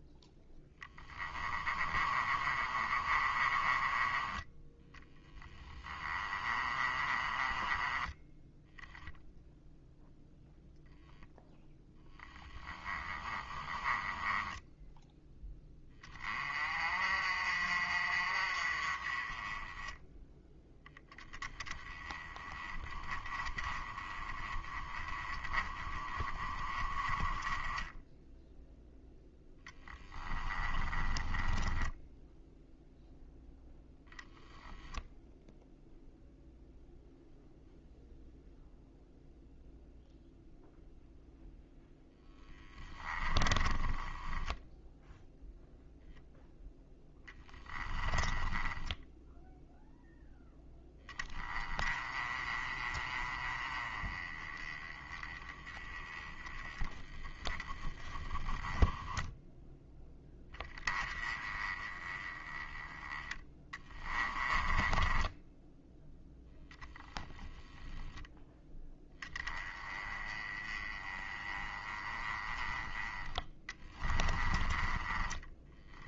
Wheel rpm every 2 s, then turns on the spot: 10, 30, 10, 30, 0, 0, 10, 10, 40, 30, 10, 20, 20, 20, 0, 20, 0, 10, 0, 0, 0, 10, 0, 10, 20, 10, 30, 20, 10, 10, 20, 10, 10, 10, 10, 20, 10, 20.
0-8 12-14 30-32 42-44 46-50